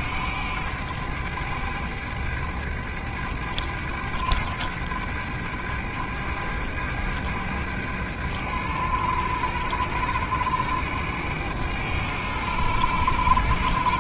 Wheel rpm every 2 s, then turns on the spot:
100, 100, 100, 100, 100, 100, 100.
none